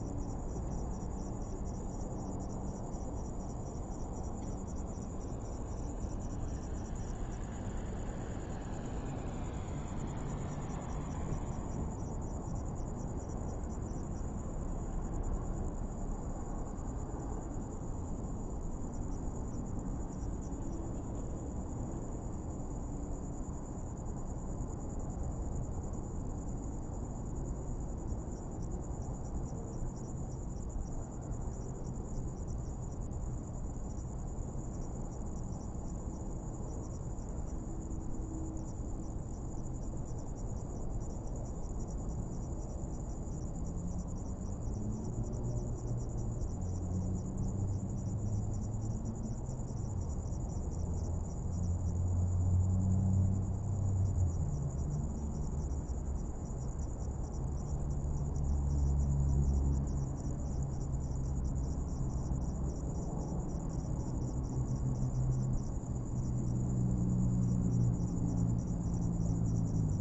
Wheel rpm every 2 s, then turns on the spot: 0, 0, 0, 0, 0, 0, 0, 0, 0, 0, 0, 0, 0, 0, 0, 0, 0, 0, 0, 0, 0, 0, 0, 0, 0, 0, 0, 0, 0, 0, 0, 0, 0, 0, 0.
none